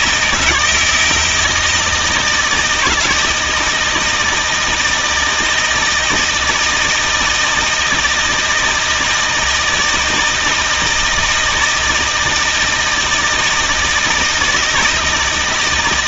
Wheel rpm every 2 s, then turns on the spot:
170, 160, 160, 160, 160, 160, 160, 160.
none